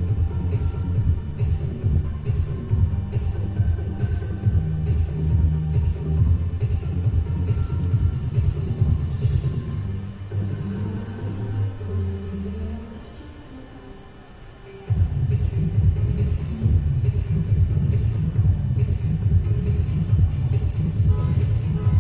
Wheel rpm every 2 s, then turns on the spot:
0, 0, 0, 0, 0, 0, 0, 0, 0, 0, 0.
none